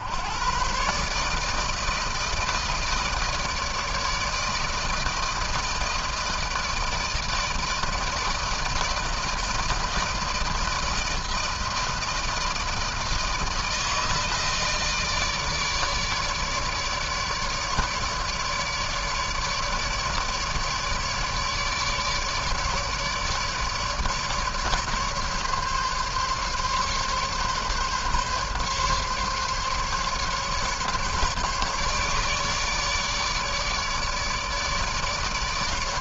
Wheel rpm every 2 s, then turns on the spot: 120, 160, 160, 160, 160, 160, 160, 160, 150, 150, 150, 150, 150, 140, 140, 150, 150, 150.
none